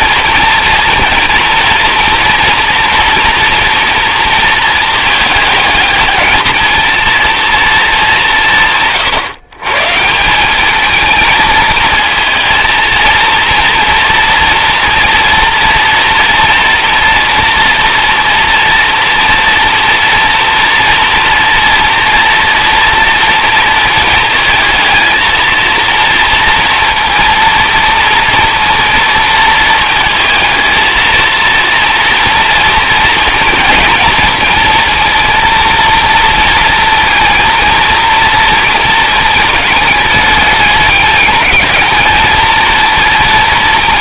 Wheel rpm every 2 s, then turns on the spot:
230, 230, 230, 220, 180, 180, 220, 230, 230, 230, 240, 240, 230, 230, 230, 220, 230, 230, 230, 230, 210, 220.
none